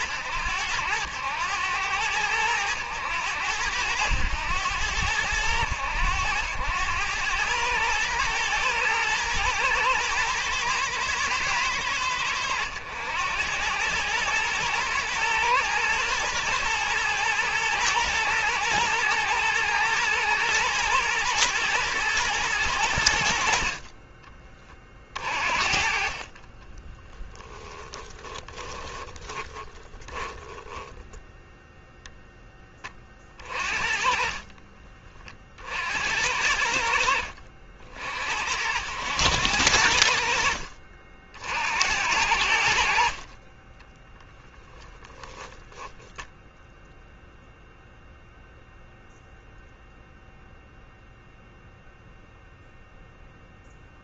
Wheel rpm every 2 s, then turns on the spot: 100, 100, 90, 100, 110, 120, 90, 110, 110, 110, 120, 110, 30, 20, 10, 10, 20, 30, 70, 80, 60, 50, 10, 0, 0, 0, 0.
26-30 34-36